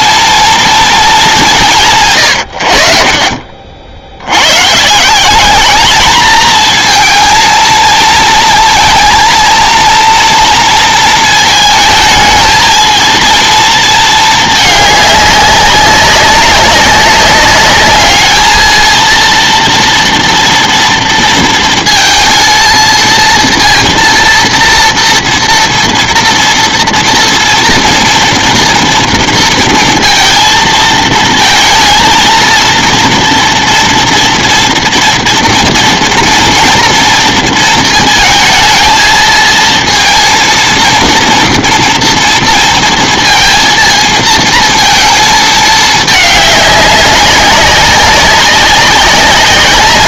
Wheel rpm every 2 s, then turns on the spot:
230, 80, 110, 220, 230, 230, 220, 210, 190, 220, 230, 230, 230, 230, 230, 230, 230, 240, 230, 220, 230, 230, 230, 200, 200.
none